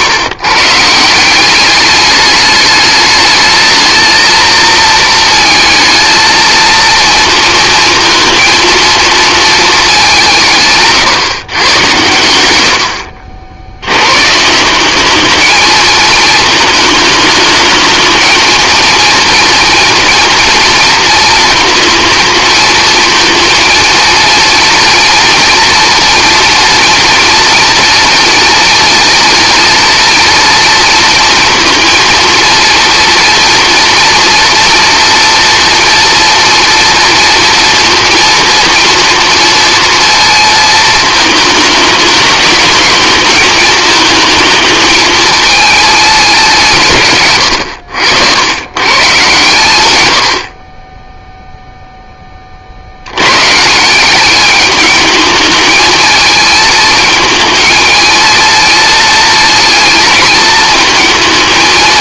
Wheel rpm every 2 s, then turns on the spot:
150, 210, 230, 230, 230, 140, 80, 190, 220, 230, 230, 220, 240, 240, 230, 230, 230, 230, 230, 230, 220, 210, 220, 150, 120, 20, 70, 210, 220, 230, 230.
12-14